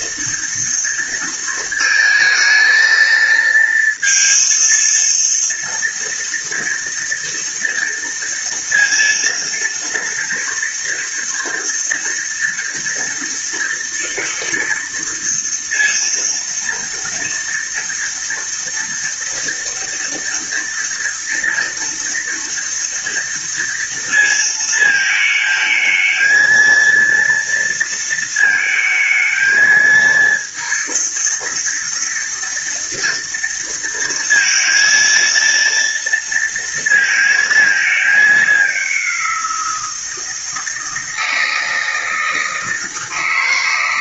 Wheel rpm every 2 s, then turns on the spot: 230, 220, 230, 230, 230, 230, 230, 230, 230, 230, 230, 230, 220, 230, 220, 230, 230, 230, 230, 180, 160, 160.
none